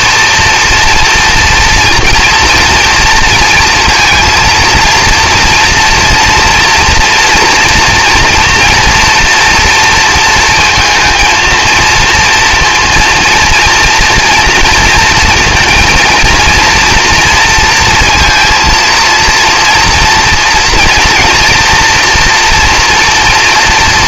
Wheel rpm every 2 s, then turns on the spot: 230, 230, 230, 230, 240, 230, 230, 230, 230, 230, 240, 230.
none